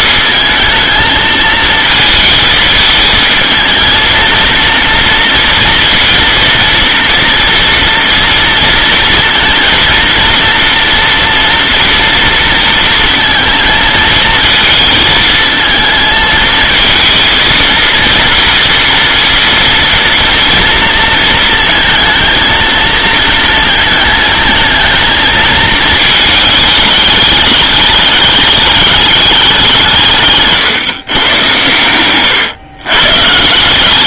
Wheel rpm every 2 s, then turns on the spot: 220, 220, 230, 230, 230, 230, 230, 220, 230, 230, 230, 230, 220, 210, 210, 150, 120.
none